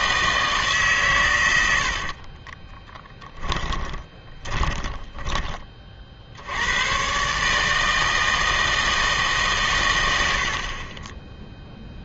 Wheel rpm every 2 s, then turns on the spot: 150, 20, 20, 90, 160, 50.
2-6